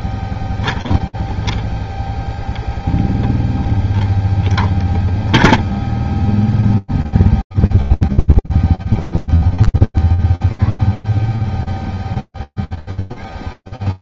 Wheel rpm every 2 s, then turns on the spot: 0, 0, 0, 0, 0, 0, 0.
none